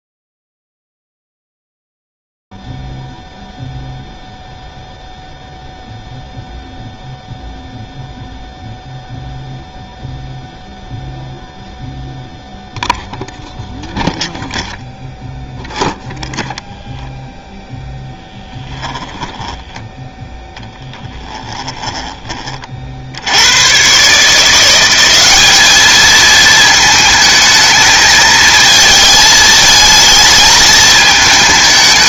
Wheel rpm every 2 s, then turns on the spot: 0, 0, 0, 0, 0, 0, 0, 0, 0, 10, 0, 40, 170, 220, 220, 220.
18-20